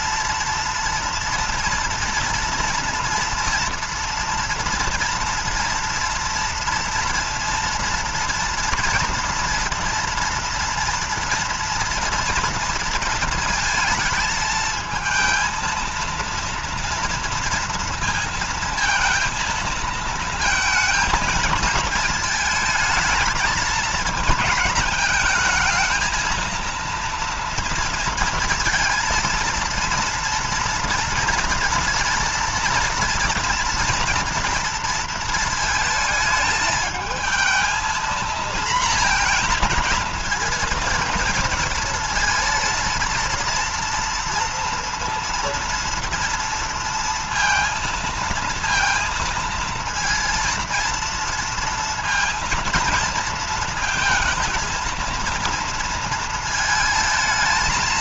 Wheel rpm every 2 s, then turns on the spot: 230, 230, 230, 230, 230, 230, 230, 220, 230, 230, 220, 220, 220, 230, 230, 230, 230, 230, 220, 230, 230, 230, 230, 230, 230, 230, 230, 230, 220.
none